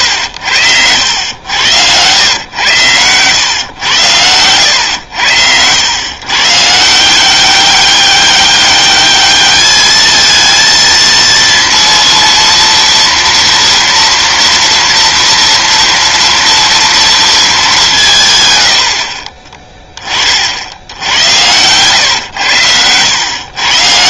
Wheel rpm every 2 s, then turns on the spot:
80, 110, 100, 150, 200, 230, 230, 230, 230, 90, 70, 100.
none